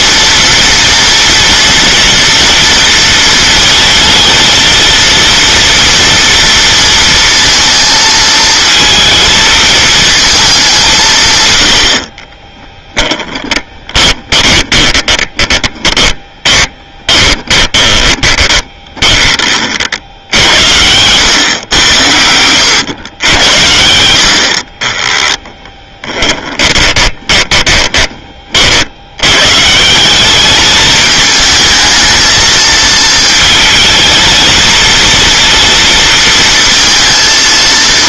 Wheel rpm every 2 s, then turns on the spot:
230, 230, 230, 230, 220, 190, 10, 20, 20, 20, 70, 100, 50, 20, 60, 220, 220, 230, 230.
12-20 24-28